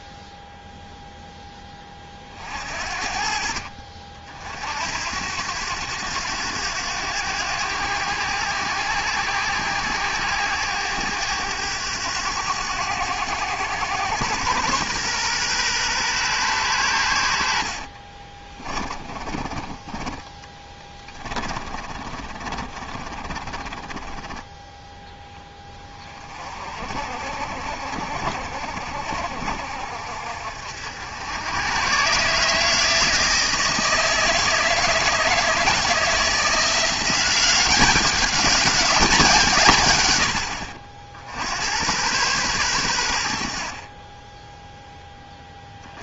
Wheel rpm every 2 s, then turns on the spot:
0, 50, 60, 90, 90, 100, 100, 110, 120, 30, 20, 30, 10, 40, 50, 60, 150, 160, 170, 190, 70, 110, 0.
18-24